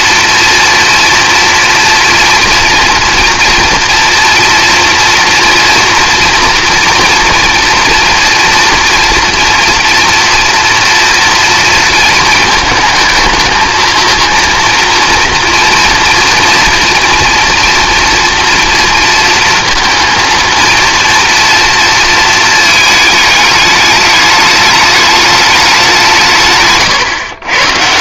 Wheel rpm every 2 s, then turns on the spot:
230, 230, 230, 230, 230, 230, 220, 230, 230, 230, 230, 220, 210, 140.
none